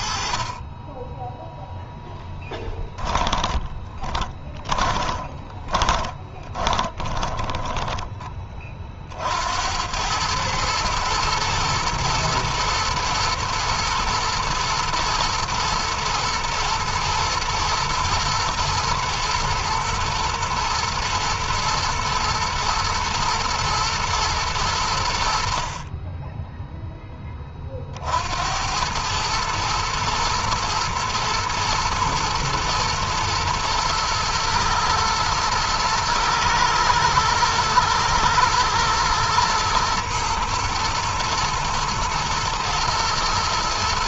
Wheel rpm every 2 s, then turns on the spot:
20, 20, 20, 10, 50, 110, 110, 120, 120, 110, 110, 110, 90, 10, 90, 110, 120, 110, 110, 110, 120, 110.
2-8